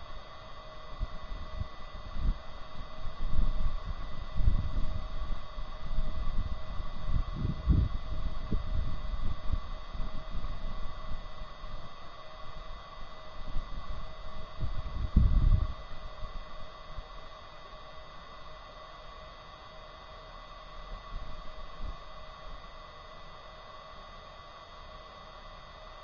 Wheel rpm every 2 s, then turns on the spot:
0, 0, 0, 0, 0, 0, 0, 0, 0, 0, 0, 0, 0.
none